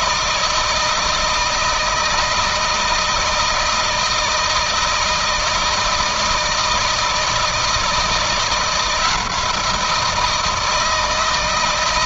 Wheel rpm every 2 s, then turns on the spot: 160, 160, 160, 160, 170, 160.
none